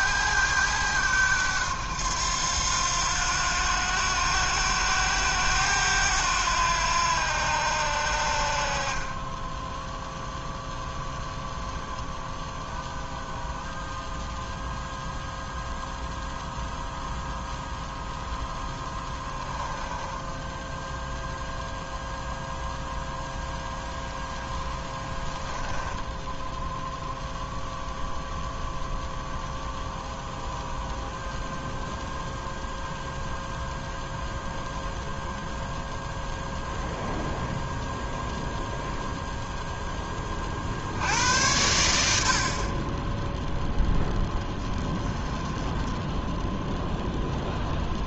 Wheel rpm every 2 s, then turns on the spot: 100, 90, 90, 80, 20, 0, 0, 0, 0, 10, 0, 0, 10, 0, 0, 0, 0, 0, 0, 0, 80, 20, 20, 0.
18-20